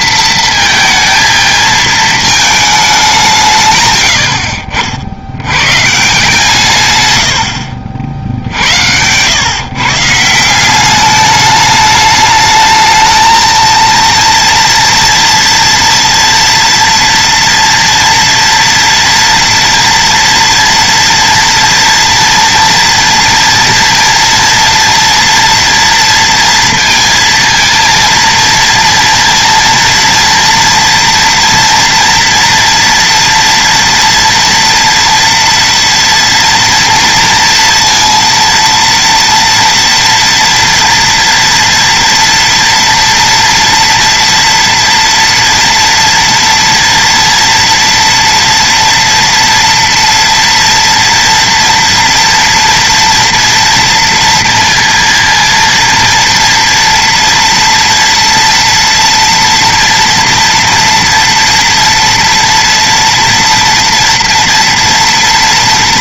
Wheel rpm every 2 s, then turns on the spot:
230, 210, 60, 130, 80, 190, 220, 230, 230, 230, 230, 230, 230, 230, 230, 240, 230, 230, 230, 230, 230, 230, 230, 230, 230, 240, 240, 230, 230, 240, 230, 230, 230.
none